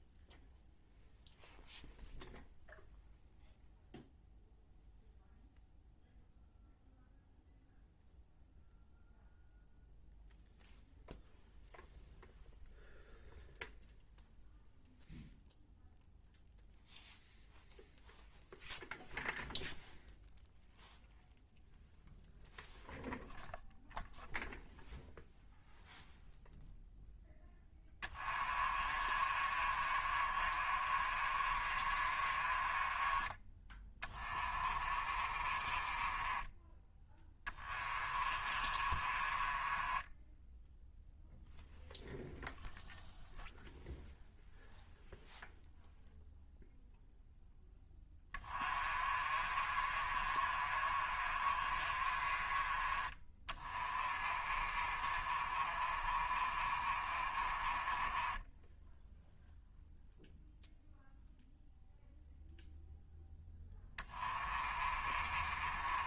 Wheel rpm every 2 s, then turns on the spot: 0, 0, 0, 0, 0, 0, 0, 0, 0, 0, 0, 0, 0, 0, 30, 40, 30, 30, 10, 30, 0, 0, 0, 0, 30, 40, 30, 40, 40, 10, 0, 0, 30.
28-36 38-40 48-52 54-60 64-66